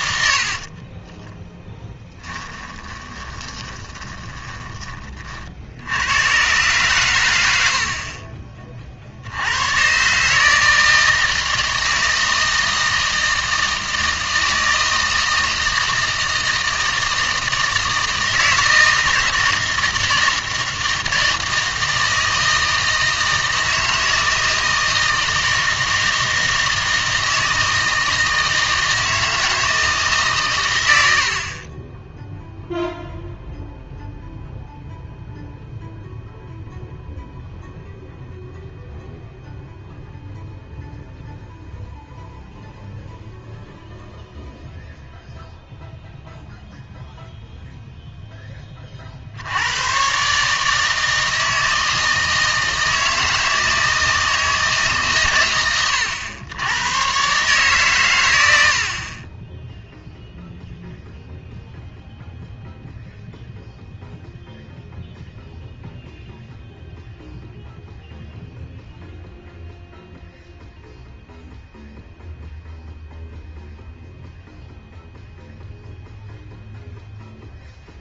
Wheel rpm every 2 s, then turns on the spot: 50, 20, 20, 120, 40, 160, 160, 160, 160, 160, 160, 160, 160, 160, 160, 120, 0, 0, 0, 0, 0, 0, 0, 0, 10, 150, 160, 160, 100, 80, 0, 0, 0, 0, 0, 0, 0, 0, 0.
0-4